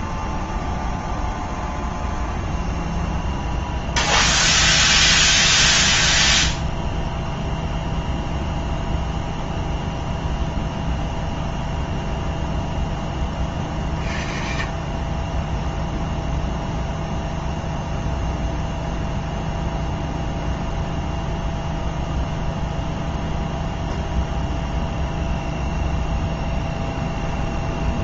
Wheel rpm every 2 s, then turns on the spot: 0, 0, 0, 0, 0, 0, 0, 40, 0, 0, 0, 0, 0, 0.
none